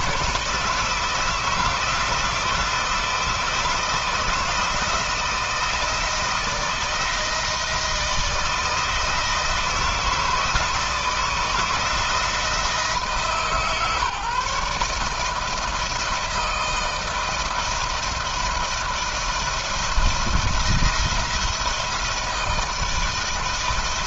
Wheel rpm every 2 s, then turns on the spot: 160, 170, 160, 160, 160, 160, 160, 160, 160, 170, 170, 160.
none